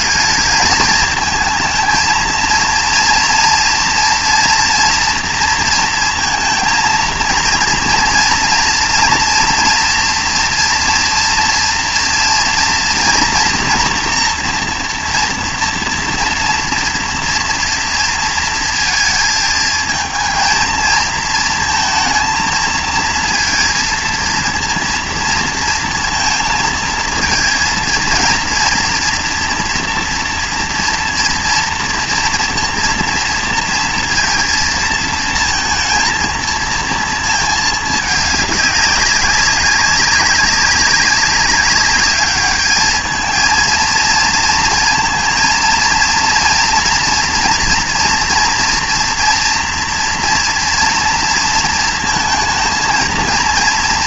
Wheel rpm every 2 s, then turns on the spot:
220, 230, 240, 230, 230, 230, 230, 230, 230, 230, 230, 230, 230, 230, 230, 230, 230, 230, 230, 200, 190, 210, 230, 230, 230, 230, 230.
none